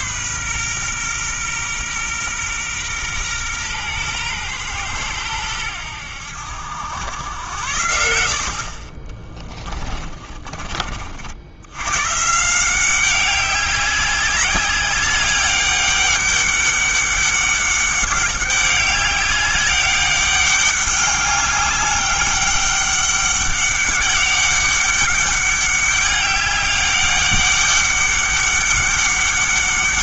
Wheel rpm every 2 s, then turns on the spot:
130, 120, 110, 90, 40, 40, 180, 200, 200, 200, 200, 200, 200, 200, 200.
none